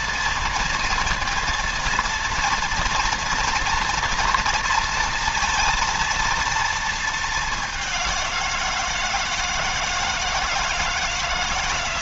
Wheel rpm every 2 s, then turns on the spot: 230, 230, 230, 220, 170, 160.
none